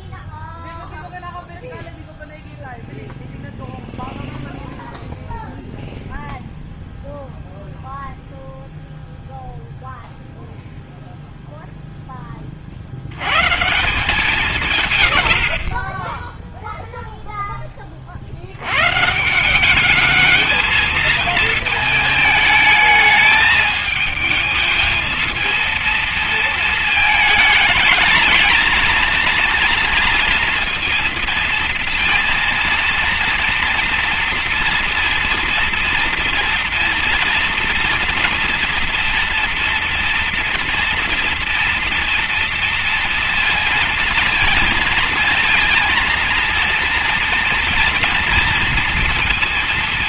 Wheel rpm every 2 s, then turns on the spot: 0, 0, 0, 0, 0, 0, 40, 170, 10, 100, 220, 220, 220, 230, 220, 230, 230, 230, 240, 230, 230, 230, 230, 230, 230.
none